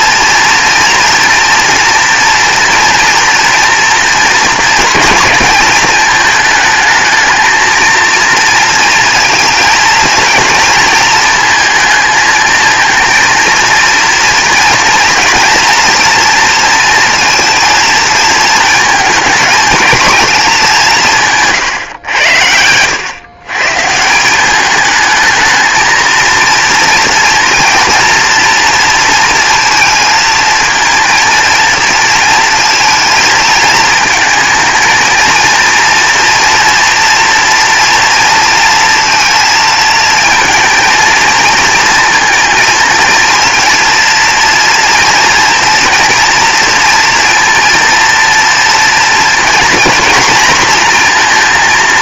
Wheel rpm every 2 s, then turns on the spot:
230, 240, 230, 220, 230, 230, 230, 230, 230, 220, 190, 110, 210, 230, 230, 230, 220, 220, 230, 230, 230, 230, 230, 230, 230, 230.
none